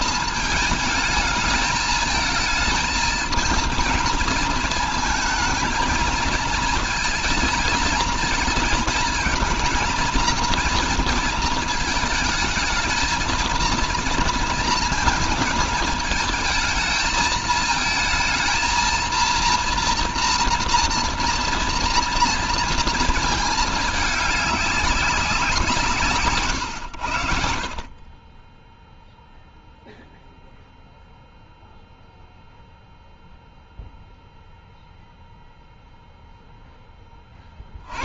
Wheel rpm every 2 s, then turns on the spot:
220, 220, 220, 220, 220, 230, 220, 230, 220, 230, 240, 230, 200, 120, 10, 0, 0, 0, 10.
none